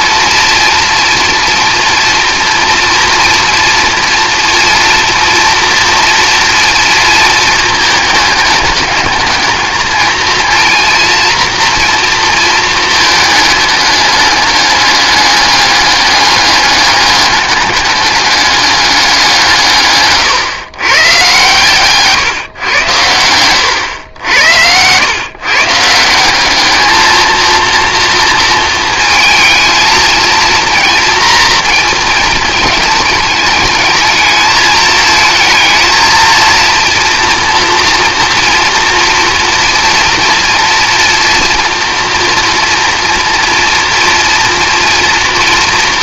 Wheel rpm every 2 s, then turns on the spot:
230, 230, 230, 230, 210, 230, 220, 210, 200, 200, 130, 110, 90, 220, 230, 230, 210, 220, 230, 240, 230, 230, 230.
none